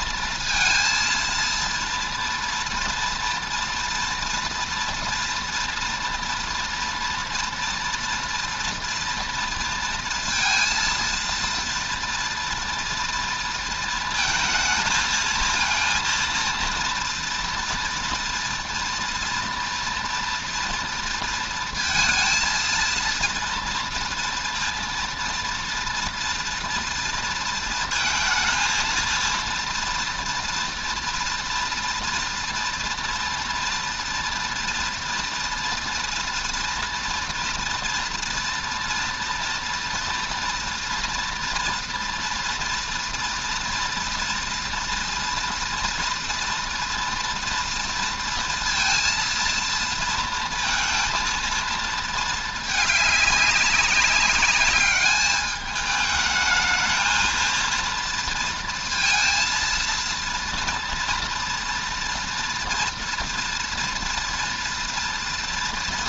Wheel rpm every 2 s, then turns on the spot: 230, 230, 230, 230, 230, 230, 230, 230, 230, 230, 230, 230, 230, 240, 230, 230, 230, 230, 230, 230, 240, 230, 230, 240, 230, 230, 210, 210, 220, 230, 230, 240, 230.
none